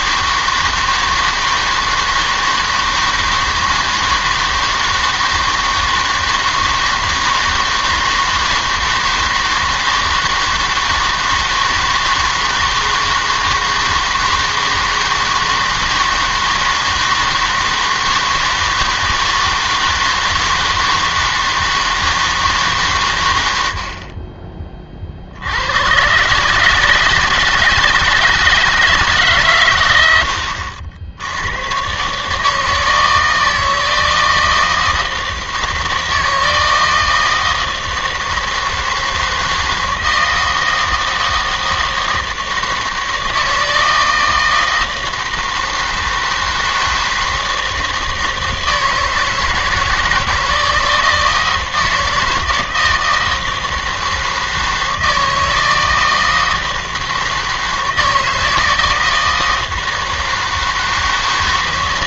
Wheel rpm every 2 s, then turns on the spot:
160, 160, 160, 160, 160, 160, 160, 160, 160, 160, 160, 150, 30, 140, 160, 70, 150, 160, 160, 160, 160, 160, 160, 160, 160, 160, 160, 160, 160, 160, 160.
none